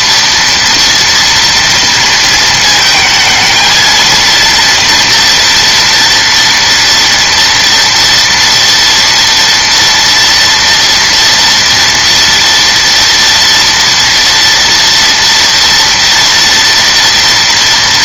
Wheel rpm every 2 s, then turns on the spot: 230, 230, 230, 230, 240, 230, 230, 230, 230.
none